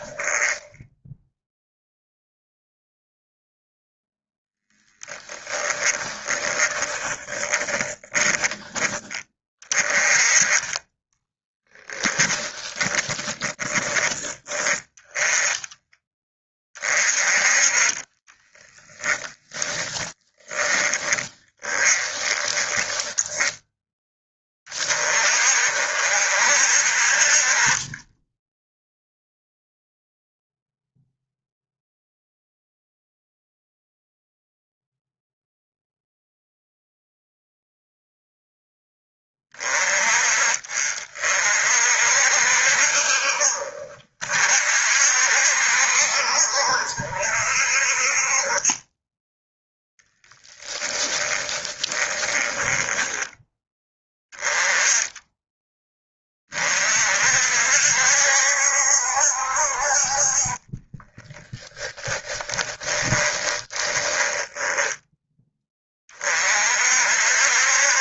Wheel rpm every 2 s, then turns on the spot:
10, 0, 20, 20, 20, 20, 10, 10, 30, 10, 20, 10, 30, 50, 0, 0, 0, 0, 0, 10, 40, 60, 60, 60, 10, 10, 10, 10, 50, 70, 20, 20, 10, 50.
4-8 10-14 18-24 50-54 60-66